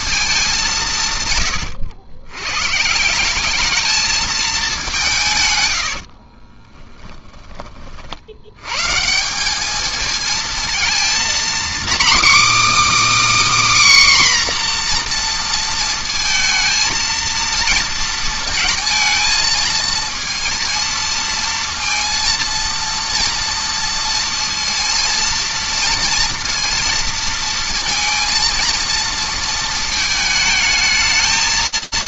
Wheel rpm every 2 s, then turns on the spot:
80, 220, 70, 30, 210, 250, 300, 230, 230, 220, 230, 230, 230, 230, 230, 190.
4-6